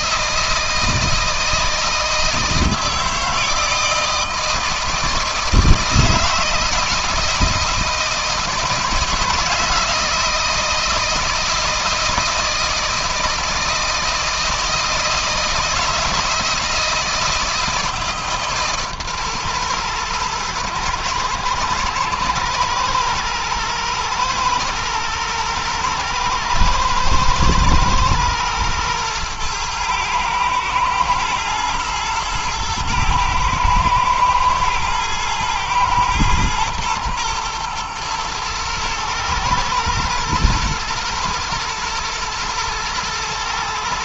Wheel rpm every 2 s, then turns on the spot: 160, 160, 160, 160, 160, 160, 170, 160, 160, 150, 120, 110, 110, 110, 120, 110, 110, 110, 110, 110, 120, 110.
none